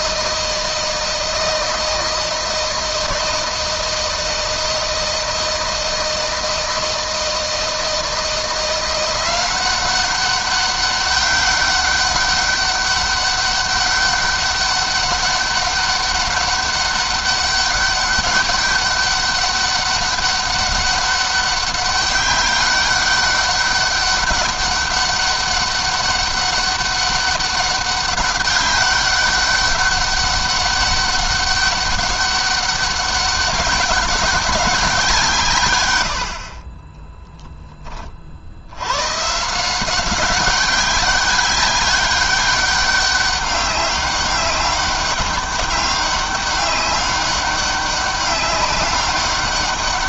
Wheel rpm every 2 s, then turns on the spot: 160, 160, 160, 160, 170, 190, 200, 200, 200, 200, 200, 190, 200, 200, 200, 200, 200, 200, 60, 60, 200, 200, 200, 200, 200.
none